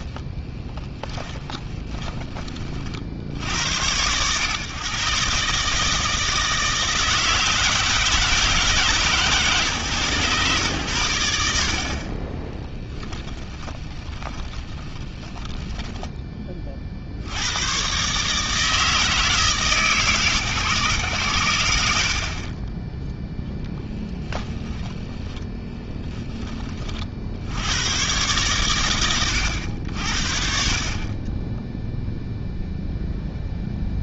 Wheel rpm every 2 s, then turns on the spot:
10, 20, 120, 160, 160, 110, 10, 20, 30, 160, 140, 20, 10, 30, 120, 40, 0.
0-2 12-16 22-26